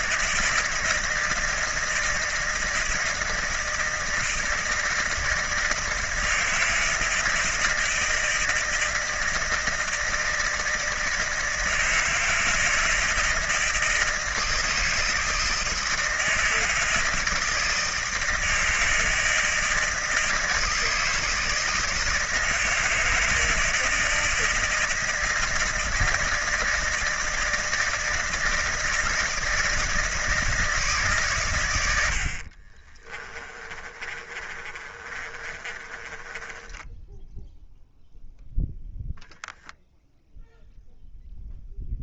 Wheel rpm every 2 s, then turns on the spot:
160, 160, 160, 160, 160, 160, 160, 160, 160, 160, 160, 160, 160, 160, 160, 160, 60, 30, 20, 10, 0.
32-38